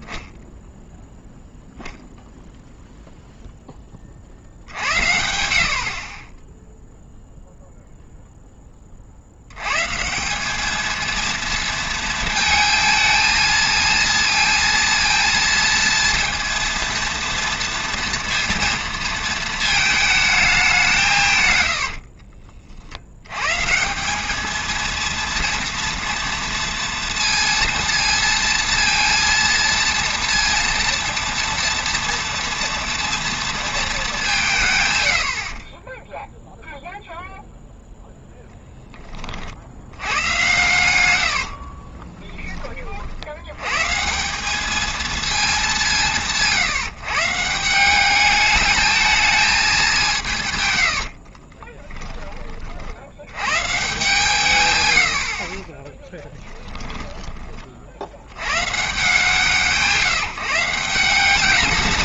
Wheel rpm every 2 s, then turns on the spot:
60, 0, 20, 210, 220, 230, 230, 230, 200, 40, 220, 230, 230, 230, 230, 140, 0, 10, 100, 10, 170, 170, 200, 180, 20, 150, 10, 50, 170, 130, 120.
52-54